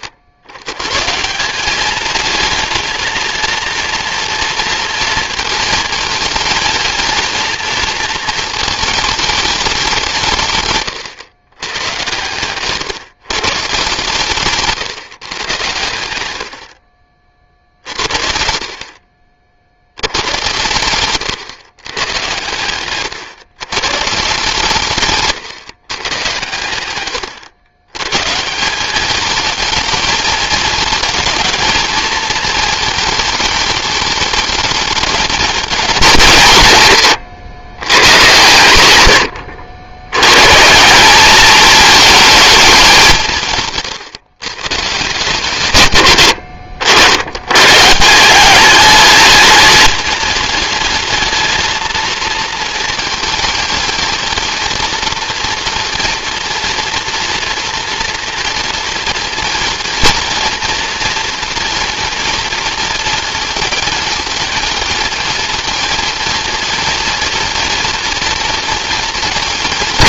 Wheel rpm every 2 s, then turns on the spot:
90, 230, 230, 230, 210, 130, 130, 140, 50, 50, 120, 120, 140, 110, 200, 220, 220, 210, 130, 100, 160, 200, 150, 80, 210, 210, 230, 230, 230, 230, 230, 230, 230, 230, 230.
16-18